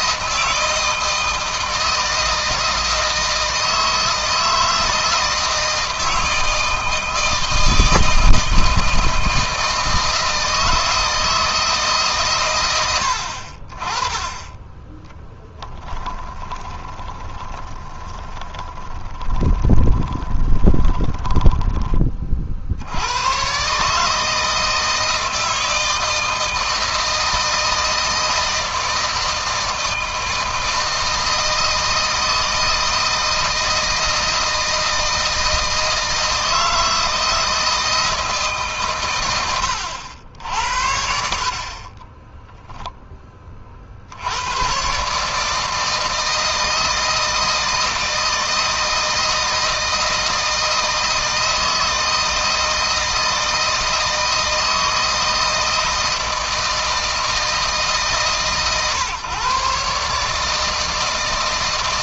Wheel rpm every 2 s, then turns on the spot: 160, 160, 160, 160, 160, 160, 100, 10, 20, 20, 10, 70, 160, 160, 160, 160, 160, 160, 160, 130, 70, 10, 120, 160, 160, 160, 160, 160, 160, 130, 160.
14-22